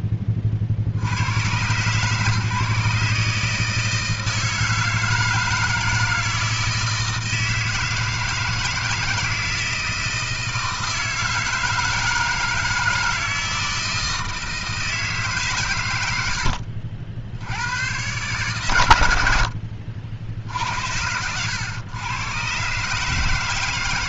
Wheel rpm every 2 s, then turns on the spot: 30, 140, 160, 160, 160, 160, 160, 160, 70, 120, 50, 120.
none